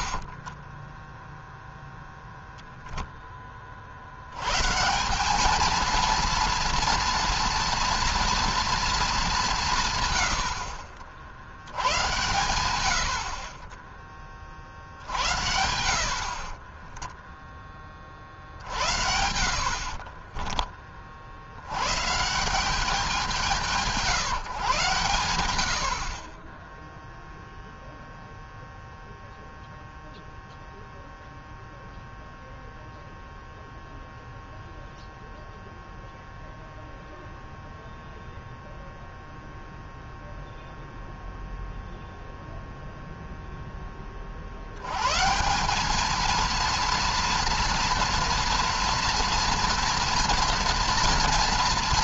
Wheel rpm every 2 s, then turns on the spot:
10, 0, 170, 230, 220, 60, 80, 50, 20, 70, 30, 190, 140, 10, 0, 0, 0, 0, 0, 0, 0, 0, 100, 230, 230, 240.
0-2 16-20